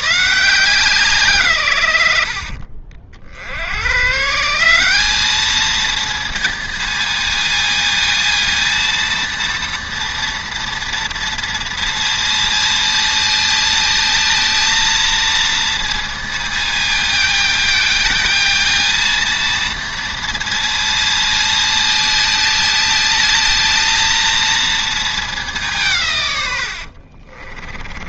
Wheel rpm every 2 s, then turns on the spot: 170, 60, 180, 230, 230, 230, 230, 230, 220, 220, 230, 220, 230, 90.
26-28